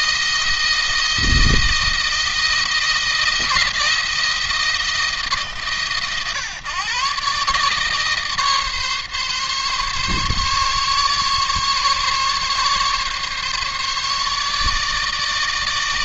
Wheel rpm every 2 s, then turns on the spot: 170, 170, 160, 130, 150, 140, 140, 150.
none